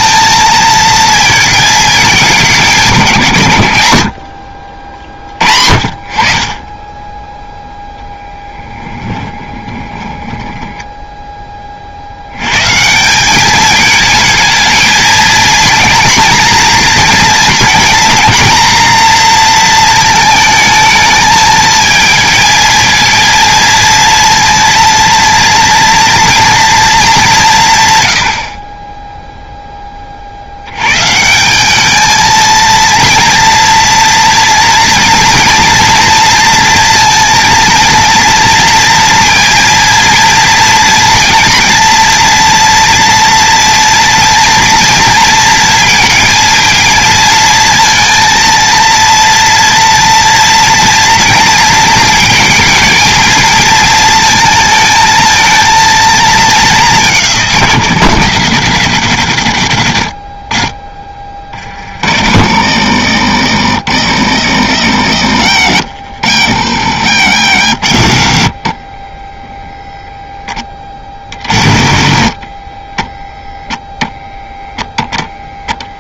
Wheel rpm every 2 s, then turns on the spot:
230, 170, 60, 10, 20, 10, 150, 220, 230, 230, 220, 230, 230, 230, 20, 120, 230, 230, 230, 230, 230, 230, 230, 230, 230, 230, 220, 220, 200, 140, 30, 80, 70, 80, 40, 40, 20, 0.
8-12 66-68 72-74